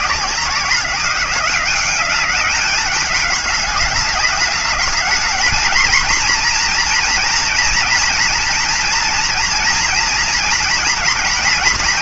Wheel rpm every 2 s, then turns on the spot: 190, 210, 210, 240, 230, 230.
none